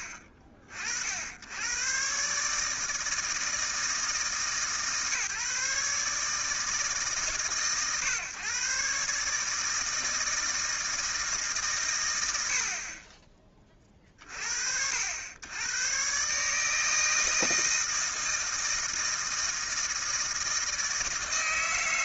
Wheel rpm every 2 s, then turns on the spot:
50, 160, 150, 150, 140, 160, 30, 70, 160, 160, 160.
none